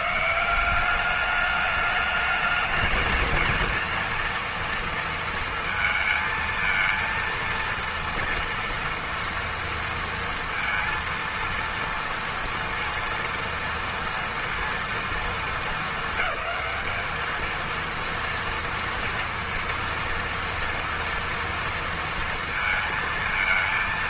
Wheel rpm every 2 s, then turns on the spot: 190, 220, 230, 230, 240, 230, 230, 230, 210, 230, 230, 230.
none